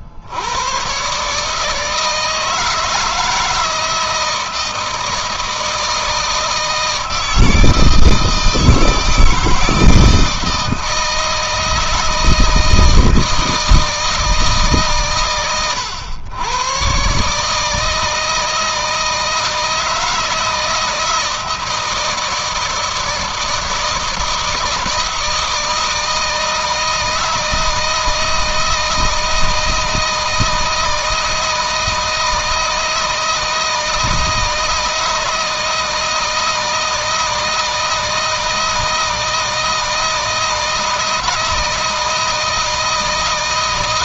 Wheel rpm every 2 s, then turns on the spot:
110, 160, 160, 160, 160, 160, 160, 140, 130, 160, 160, 160, 160, 160, 160, 160, 160, 160, 160, 160, 160, 160.
none